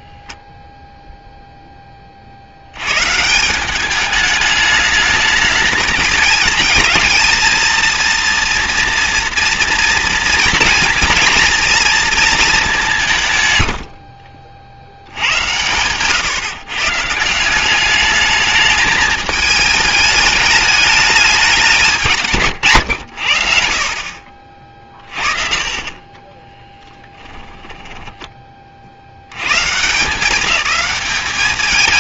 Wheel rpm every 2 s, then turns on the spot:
0, 100, 210, 210, 230, 230, 190, 70, 130, 210, 210, 110, 40, 30, 20, 200.
24-28